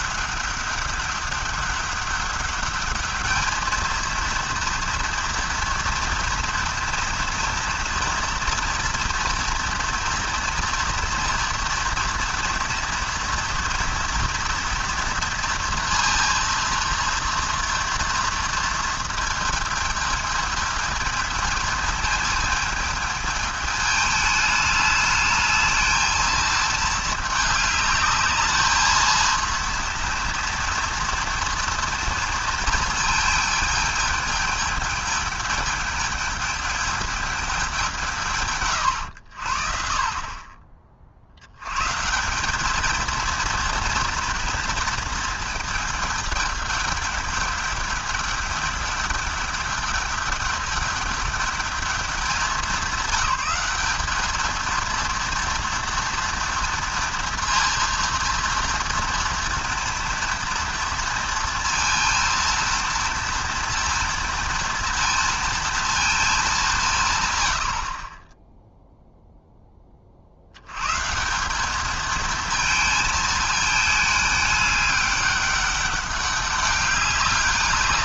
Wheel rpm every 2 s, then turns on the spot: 200, 200, 230, 230, 230, 240, 230, 230, 230, 230, 220, 220, 210, 220, 220, 230, 230, 220, 220, 120, 40, 210, 230, 210, 210, 210, 190, 230, 230, 230, 230, 230, 230, 180, 0, 120, 220, 200, 200.
none